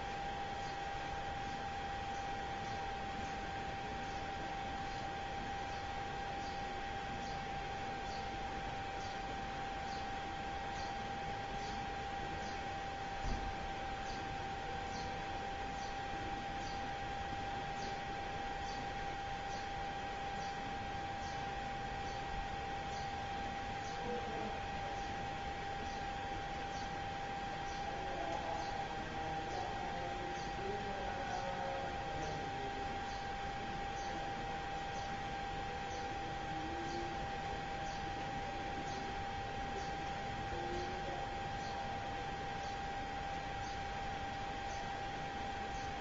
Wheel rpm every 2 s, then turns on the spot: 0, 0, 0, 0, 0, 0, 0, 0, 0, 0, 0, 0, 0, 0, 0, 0, 0, 0, 0, 0, 0, 0, 0.
none